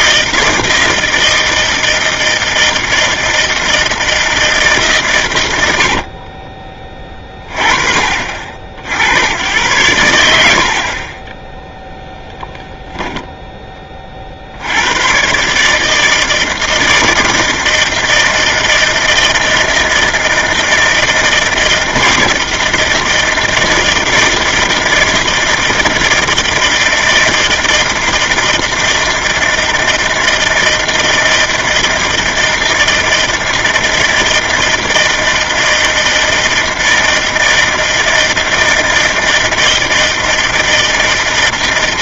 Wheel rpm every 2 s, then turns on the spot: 160, 160, 160, 30, 50, 70, 0, 60, 160, 160, 160, 160, 160, 160, 160, 160, 160, 160, 160, 160, 160.
6-8